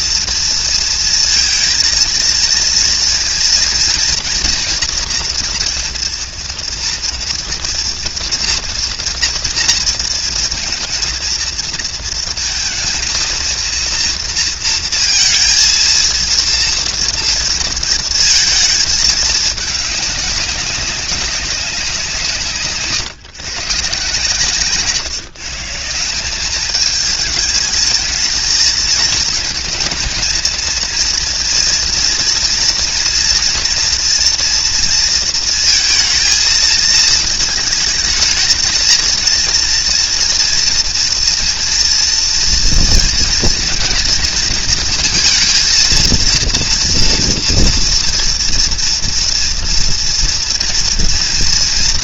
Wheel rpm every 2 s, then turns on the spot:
230, 230, 240, 230, 230, 230, 230, 230, 230, 220, 190, 150, 150, 210, 220, 220, 230, 230, 230, 220, 230, 230, 230, 230, 230, 240.
none